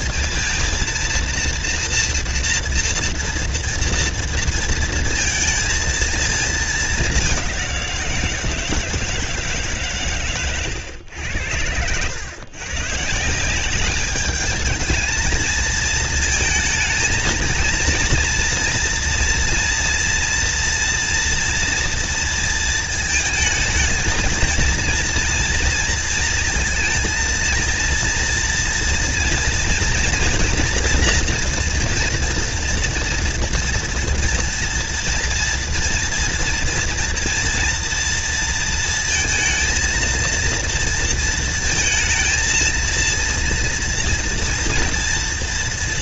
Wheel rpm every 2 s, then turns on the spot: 230, 230, 220, 200, 160, 100, 160, 220, 230, 230, 240, 220, 230, 230, 230, 230, 230, 230, 230, 230, 230, 230, 230.
none